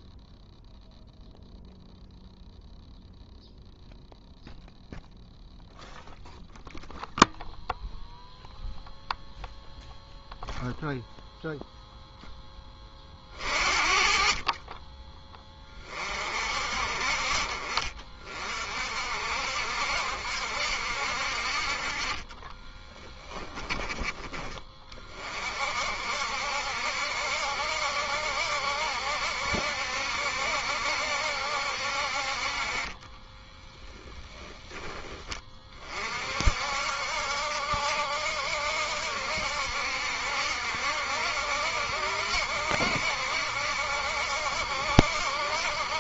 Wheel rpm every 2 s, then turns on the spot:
0, 0, 0, 0, 0, 0, 20, 20, 50, 50, 60, 20, 30, 70, 70, 70, 30, 10, 60, 70, 70, 70, 70.
22-24